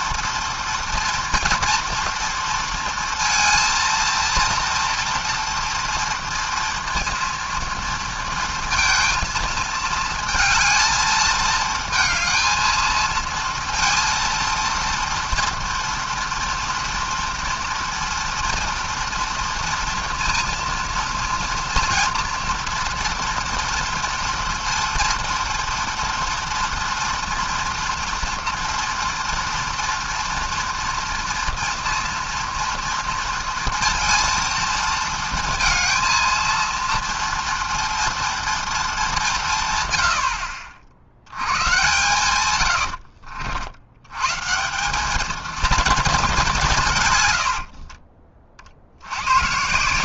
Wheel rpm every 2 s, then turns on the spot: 240, 230, 230, 230, 230, 220, 220, 230, 230, 240, 240, 230, 230, 230, 230, 230, 230, 230, 230, 220, 60, 100, 160, 190, 50.
none